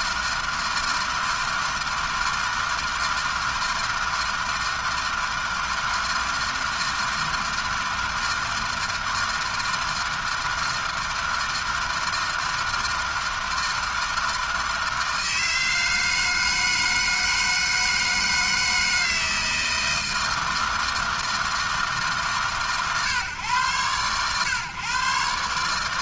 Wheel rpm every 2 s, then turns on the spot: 160, 160, 160, 160, 160, 160, 160, 160, 160, 160, 160, 130, 130.
none